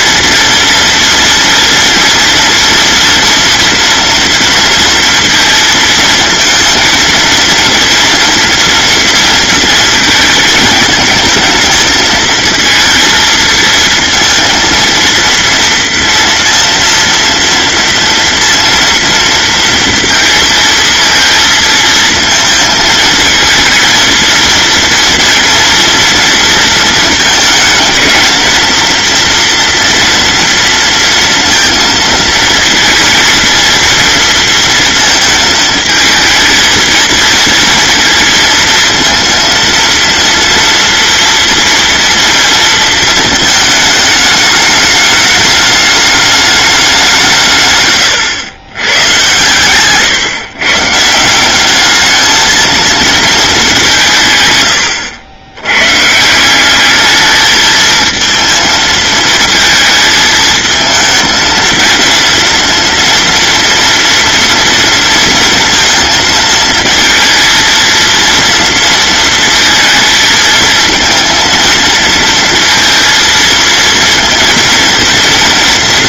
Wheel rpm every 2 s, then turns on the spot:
230, 230, 230, 230, 230, 220, 220, 230, 230, 230, 230, 220, 230, 230, 230, 230, 230, 230, 220, 230, 230, 230, 210, 210, 100, 130, 220, 120, 180, 220, 220, 230, 230, 230, 230, 230, 230, 230.
none